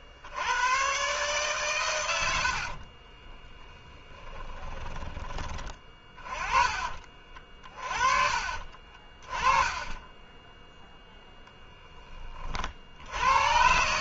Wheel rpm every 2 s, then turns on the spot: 80, 70, 20, 30, 40, 0, 40.
2-6 8-10